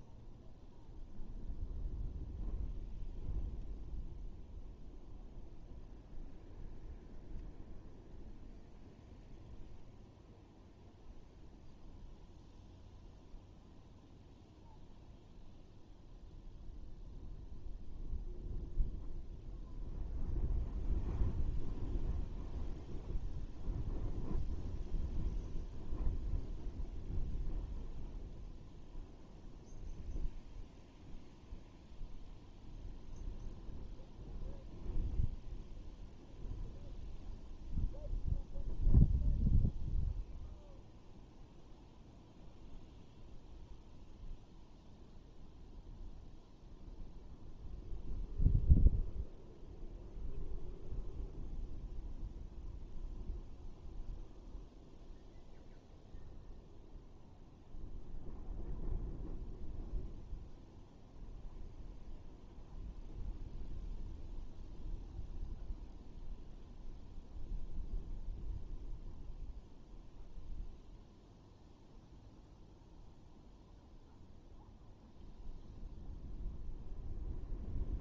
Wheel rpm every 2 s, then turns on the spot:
0, 0, 0, 0, 0, 0, 0, 0, 0, 0, 0, 0, 0, 0, 0, 0, 0, 0, 0, 0, 0, 0, 0, 0, 0, 0, 0, 0, 0, 0, 0, 0, 0, 0, 0, 0, 0, 0, 0.
none